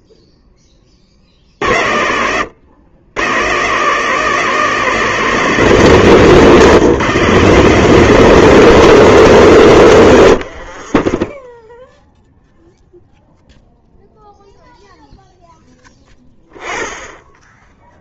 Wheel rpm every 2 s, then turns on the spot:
0, 70, 140, 140, 170, 120, 10, 0, 20.
10-12